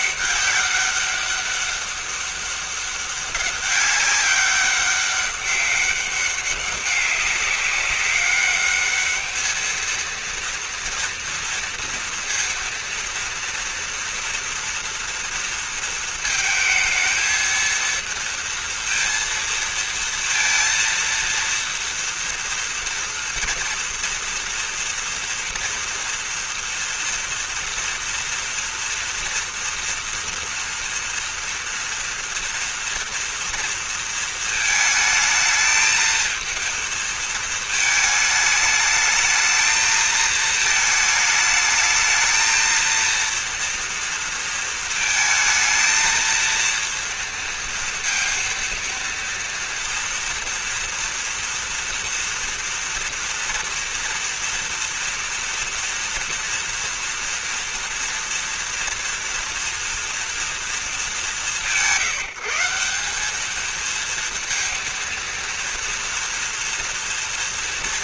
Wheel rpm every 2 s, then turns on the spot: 200, 200, 200, 200, 210, 230, 230, 230, 230, 230, 230, 230, 230, 240, 230, 230, 230, 220, 220, 220, 220, 220, 230, 230, 230, 230, 230, 230, 230, 230, 220, 180, 230, 240.
none